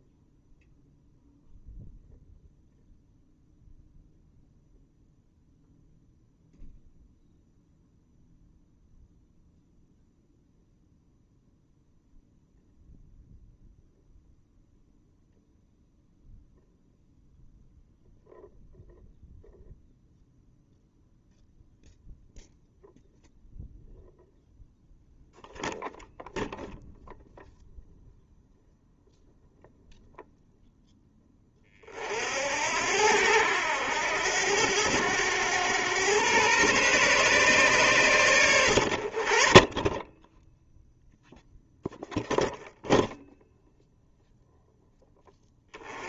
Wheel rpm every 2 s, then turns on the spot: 0, 0, 0, 0, 0, 0, 0, 0, 0, 0, 0, 0, 0, 0, 0, 0, 80, 90, 130, 80, 0, 0, 0.
none